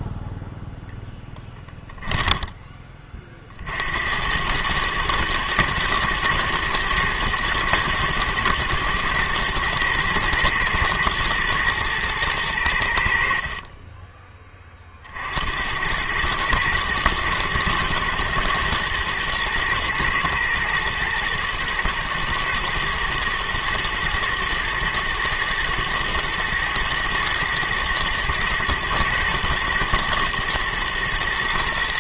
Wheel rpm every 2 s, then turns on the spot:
0, 10, 110, 120, 120, 120, 100, 20, 110, 120, 110, 120, 110, 110, 110, 110.
none